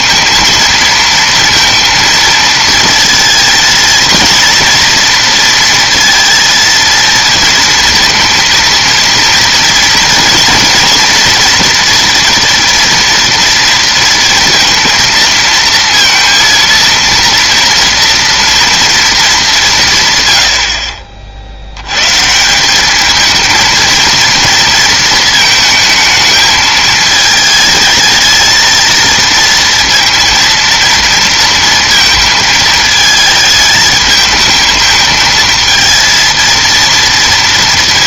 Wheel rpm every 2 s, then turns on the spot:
230, 230, 230, 230, 230, 230, 230, 230, 230, 190, 60, 220, 220, 220, 230, 230, 220, 220, 230.
none